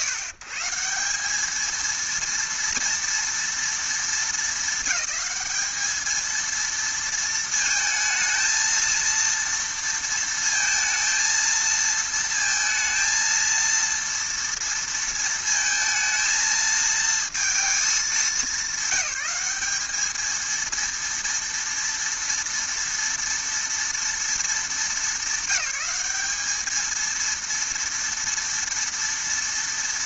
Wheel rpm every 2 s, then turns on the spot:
140, 230, 210, 230, 230, 230, 230, 230, 220, 190, 230, 230, 210, 210, 230.
none